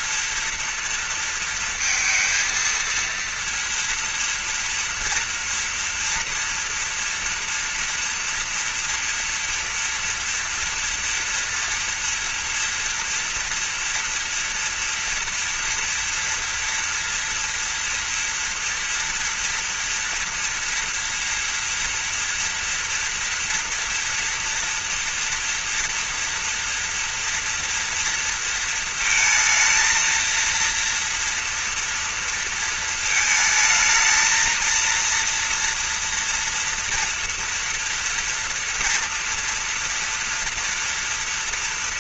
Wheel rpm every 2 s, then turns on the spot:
230, 230, 230, 230, 230, 230, 230, 240, 230, 230, 240, 230, 230, 230, 230, 230, 220, 230, 230, 230, 230.
none